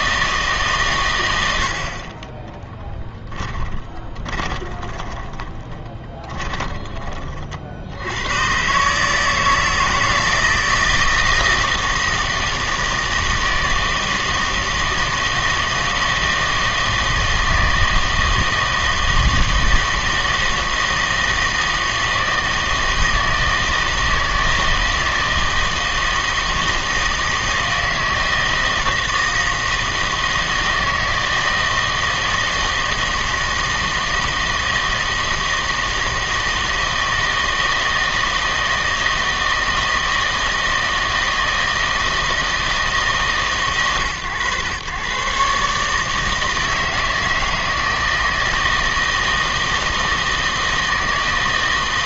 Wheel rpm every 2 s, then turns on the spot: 150, 10, 20, 20, 120, 160, 160, 160, 160, 160, 160, 160, 160, 160, 160, 160, 160, 160, 160, 160, 160, 160, 120, 160, 160, 160.
2-8